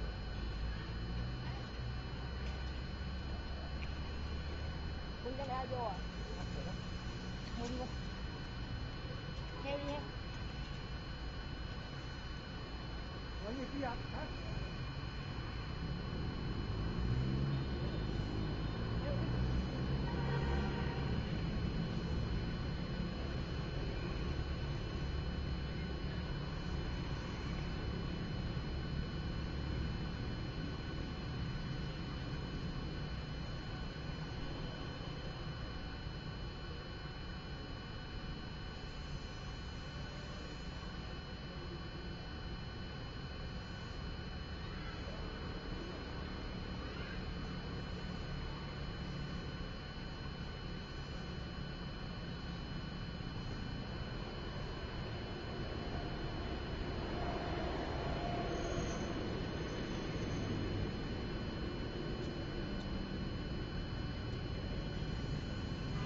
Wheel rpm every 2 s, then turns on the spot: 0, 0, 0, 0, 0, 0, 0, 0, 0, 0, 0, 0, 0, 0, 0, 0, 0, 0, 0, 0, 0, 0, 0, 0, 0, 0, 0, 0, 0, 0, 0, 0, 0.
none